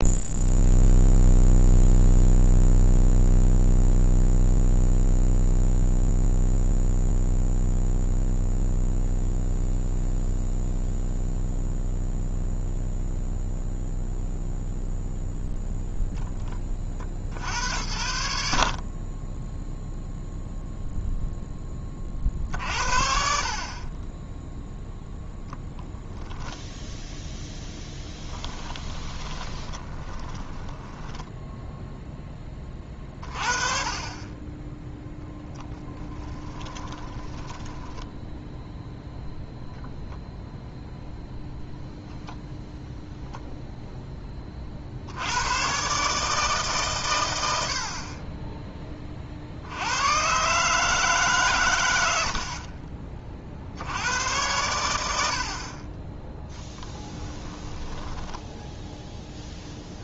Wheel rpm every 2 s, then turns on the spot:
0, 0, 0, 0, 0, 0, 0, 0, 40, 50, 0, 60, 10, 10, 20, 10, 30, 10, 10, 0, 0, 0, 60, 130, 20, 150, 40, 100, 10, 0.
28-32 36-38 56-58